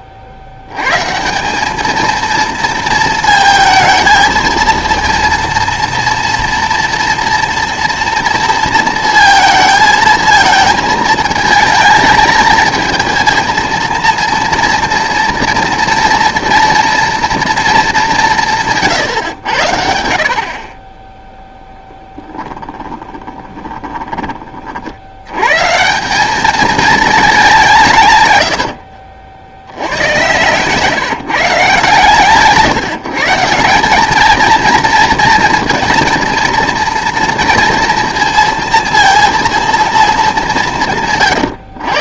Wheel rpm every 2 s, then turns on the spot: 80, 220, 230, 230, 230, 230, 220, 240, 230, 160, 40, 10, 30, 220, 90, 130, 140, 220, 230, 230, 200.
22-24 28-32